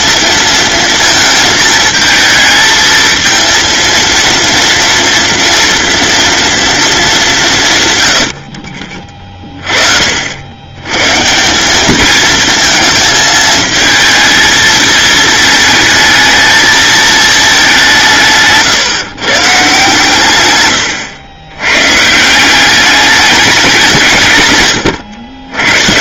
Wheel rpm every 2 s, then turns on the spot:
230, 220, 230, 230, 50, 110, 220, 220, 220, 160, 120, 200, 110.
20-22